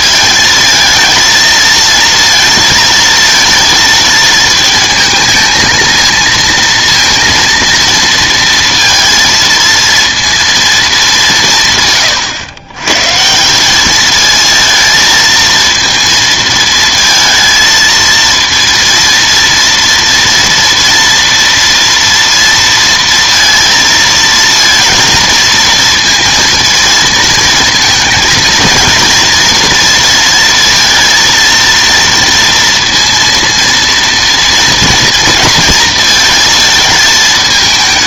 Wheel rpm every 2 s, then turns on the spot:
230, 230, 220, 230, 230, 220, 130, 230, 230, 230, 230, 230, 230, 230, 230, 230, 230, 230, 220.
none